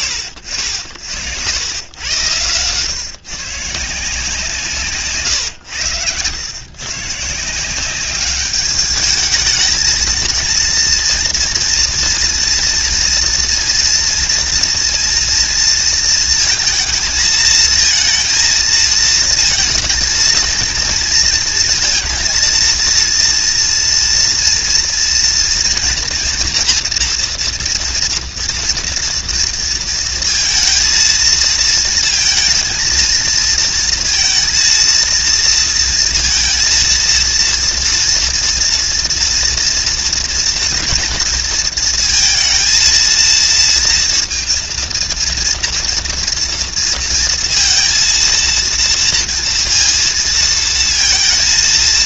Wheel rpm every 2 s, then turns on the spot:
50, 120, 160, 110, 200, 230, 230, 230, 220, 230, 230, 230, 240, 240, 230, 230, 230, 230, 230, 230, 230, 230, 230, 230, 230, 230.
none